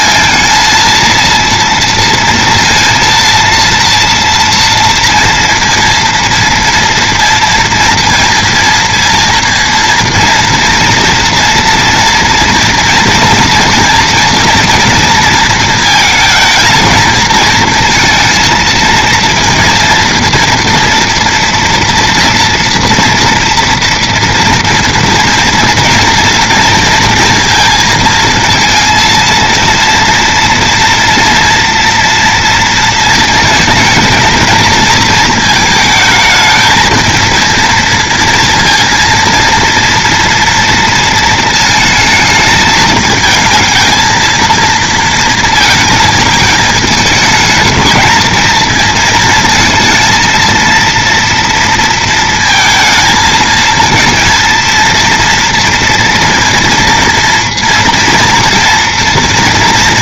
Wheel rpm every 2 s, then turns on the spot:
230, 230, 230, 230, 230, 240, 240, 240, 230, 230, 240, 230, 240, 230, 230, 230, 230, 230, 220, 230, 230, 220, 230, 220, 220, 230, 220, 230, 230, 230.
none